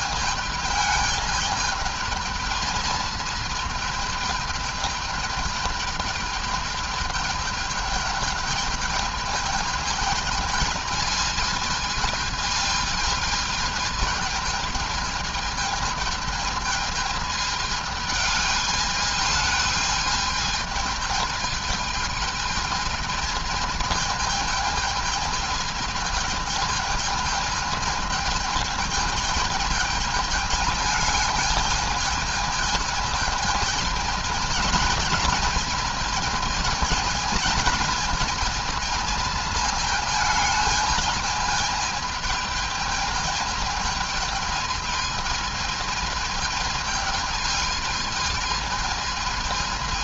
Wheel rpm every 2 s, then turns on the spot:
210, 220, 210, 210, 210, 220, 220, 220, 220, 210, 220, 220, 220, 220, 220, 210, 220, 220, 220, 230, 220, 210, 220, 220, 220.
none